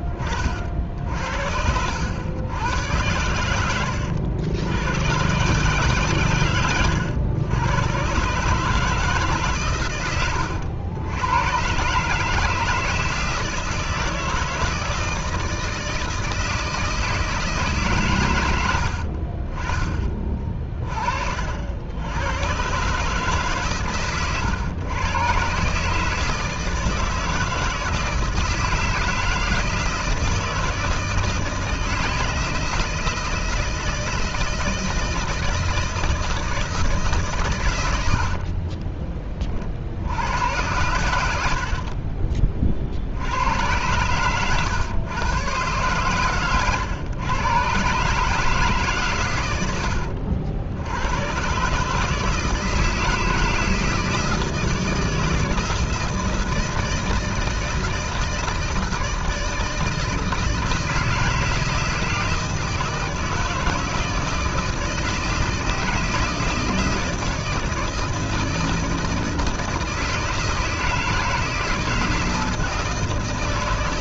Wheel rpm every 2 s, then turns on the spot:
50, 100, 90, 110, 140, 90, 160, 160, 160, 90, 30, 120, 120, 160, 160, 160, 160, 160, 160, 40, 90, 40, 120, 120, 160, 80, 160, 160, 160, 160, 160, 160, 160, 160, 160, 160, 160.
38-40 44-46